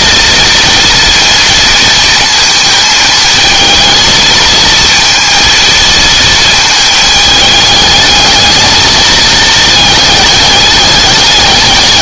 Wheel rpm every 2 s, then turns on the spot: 240, 220, 230, 220, 220, 210.
none